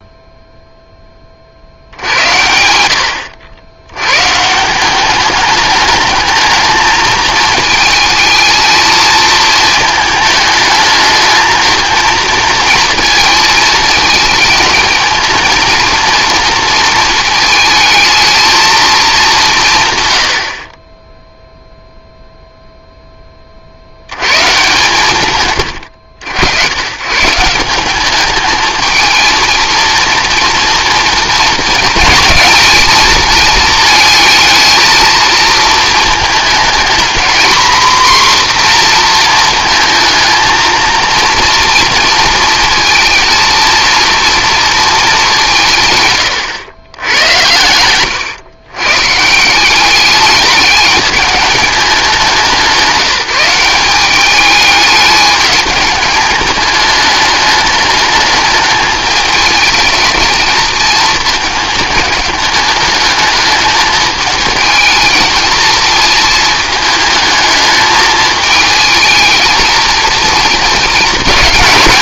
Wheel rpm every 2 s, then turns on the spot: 0, 80, 190, 220, 220, 220, 230, 220, 230, 220, 30, 0, 140, 110, 220, 230, 220, 220, 220, 240, 220, 230, 220, 100, 120, 200, 180, 210, 210, 210, 220, 210, 220, 220, 220, 220.
none